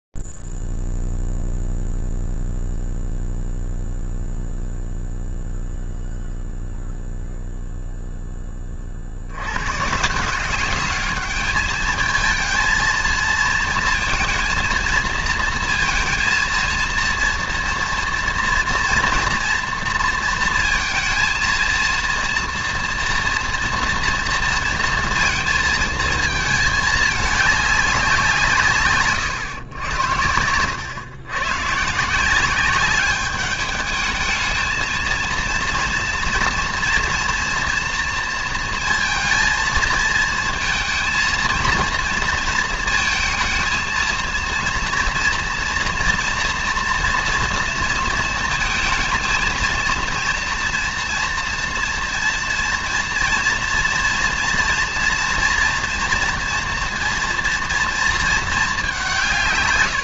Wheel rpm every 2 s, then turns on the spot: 0, 0, 0, 0, 0, 140, 220, 230, 220, 230, 230, 230, 230, 220, 180, 100, 180, 220, 230, 230, 220, 230, 230, 230, 230, 230, 230, 240, 230, 220.
none